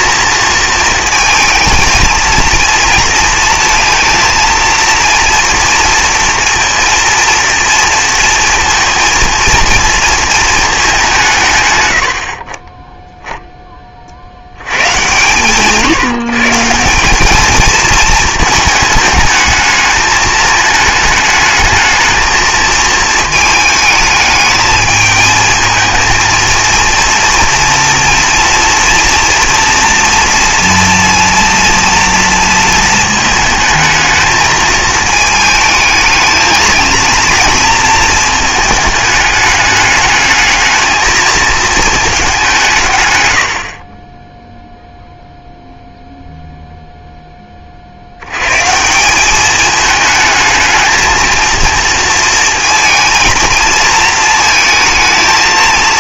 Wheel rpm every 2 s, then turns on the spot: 230, 230, 230, 230, 230, 210, 30, 90, 160, 220, 220, 220, 220, 230, 240, 230, 220, 220, 220, 220, 220, 170, 0, 0, 150, 220, 230, 220.
none